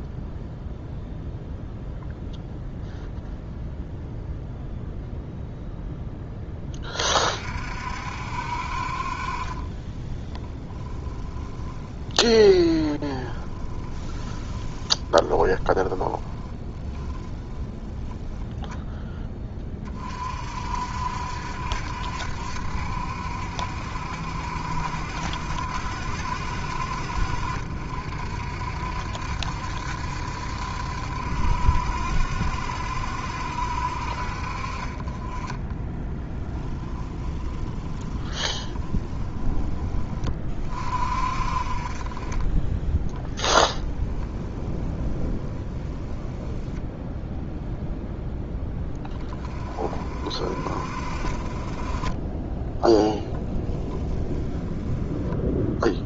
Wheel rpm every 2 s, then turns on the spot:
0, 0, 0, 30, 40, 10, 20, 20, 10, 10, 60, 60, 60, 60, 60, 60, 70, 30, 10, 10, 40, 10, 10, 0, 20, 40, 10, 10.
10-16 36-38 42-46 52-54